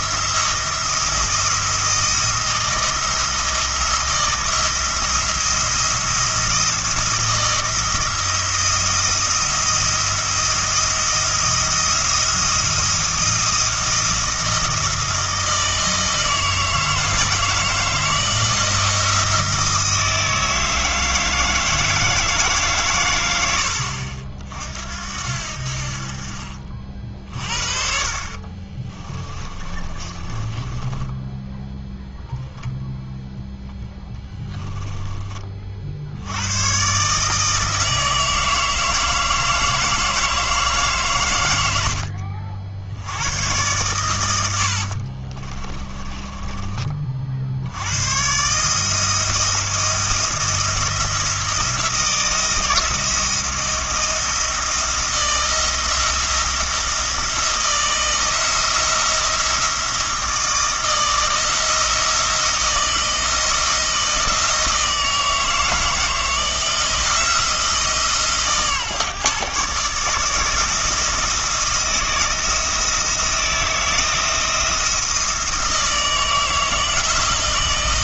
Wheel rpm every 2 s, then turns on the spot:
160, 160, 170, 170, 170, 170, 170, 160, 160, 170, 160, 140, 60, 40, 30, 20, 0, 10, 110, 160, 150, 70, 80, 30, 150, 170, 160, 160, 170, 170, 170, 160, 160, 170, 140, 160, 160, 160, 160.
28-32 34-36 44-46